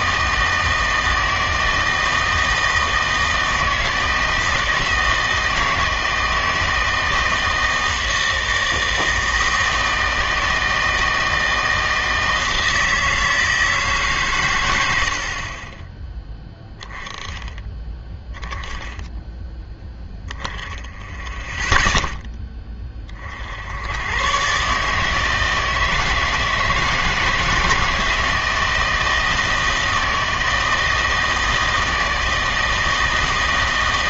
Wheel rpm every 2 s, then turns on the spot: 160, 160, 160, 160, 160, 160, 160, 110, 10, 10, 10, 20, 150, 160, 160, 160, 160.
none